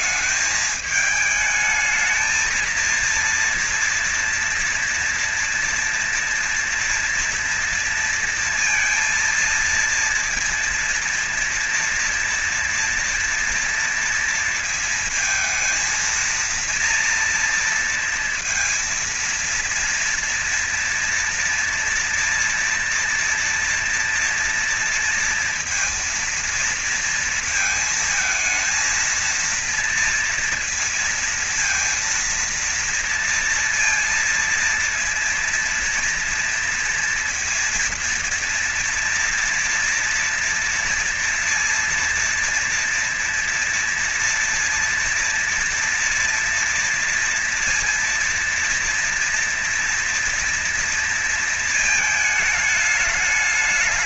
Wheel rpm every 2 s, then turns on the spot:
210, 220, 230, 240, 230, 230, 230, 230, 230, 230, 230, 230, 230, 230, 230, 230, 230, 230, 240, 240, 230, 230, 240, 230, 230, 240, 220.
none